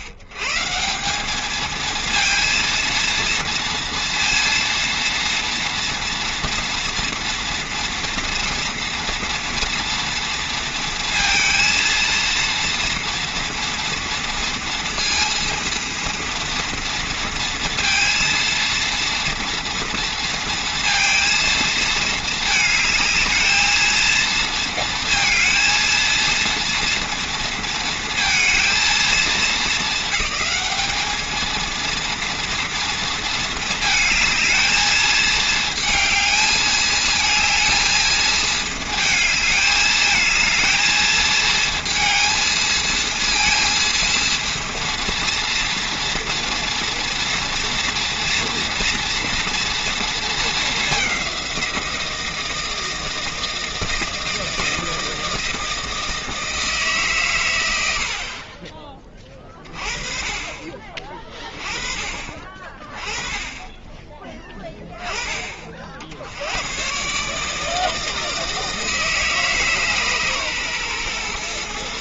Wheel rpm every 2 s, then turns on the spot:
120, 230, 230, 230, 230, 230, 230, 230, 230, 230, 230, 220, 230, 230, 230, 200, 230, 220, 220, 220, 220, 220, 230, 230, 230, 220, 160, 160, 160, 50, 30, 40, 20, 80, 160, 140.
none